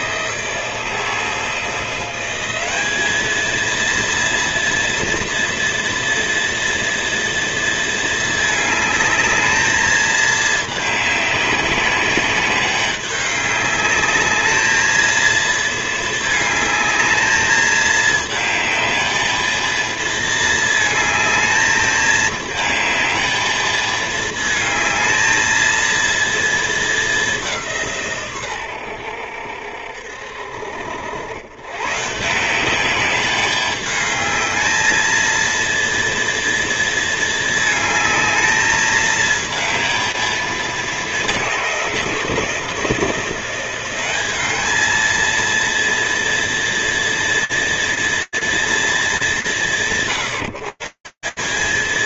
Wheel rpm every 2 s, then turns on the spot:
160, 210, 240, 230, 210, 210, 200, 220, 220, 220, 220, 220, 220, 210, 90, 70, 190, 220, 230, 220, 210, 170, 210, 230, 210, 170.
none